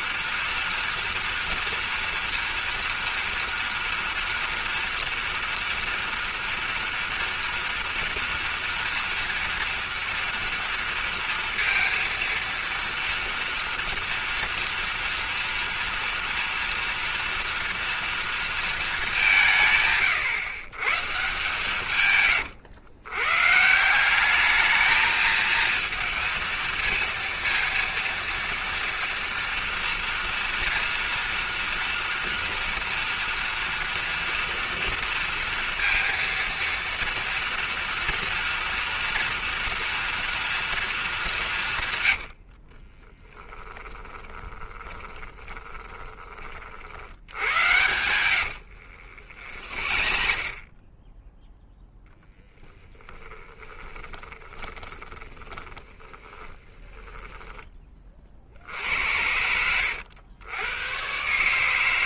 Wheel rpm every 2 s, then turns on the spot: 230, 230, 230, 240, 230, 230, 230, 230, 230, 230, 120, 130, 210, 230, 230, 230, 230, 230, 230, 240, 230, 60, 10, 40, 100, 40, 10, 20, 20, 60, 100.
42-46 48-50 52-58